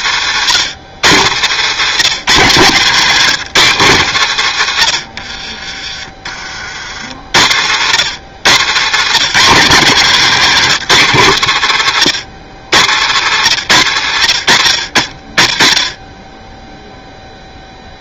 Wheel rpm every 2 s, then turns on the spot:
100, 150, 100, 50, 110, 170, 90, 50, 10.
8-10